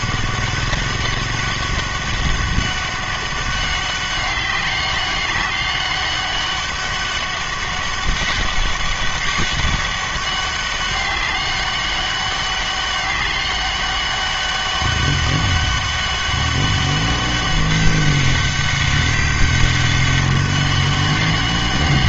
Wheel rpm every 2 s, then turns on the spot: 200, 200, 190, 200, 200, 200, 200, 200, 200, 200, 200.
none